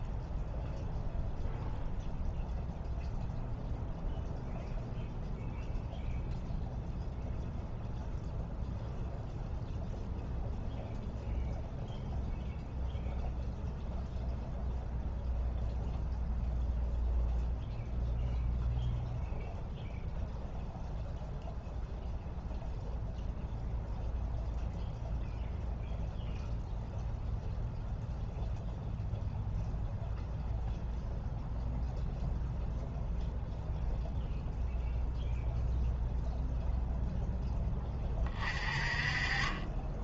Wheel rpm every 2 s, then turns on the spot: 0, 0, 0, 0, 0, 0, 0, 0, 0, 0, 0, 0, 0, 0, 0, 0, 0, 0, 0, 30.
none